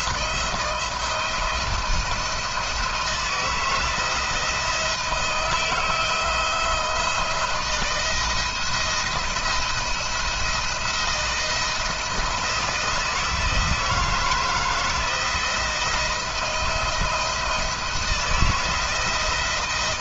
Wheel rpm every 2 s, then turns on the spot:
170, 160, 170, 160, 160, 170, 160, 160, 170, 170.
none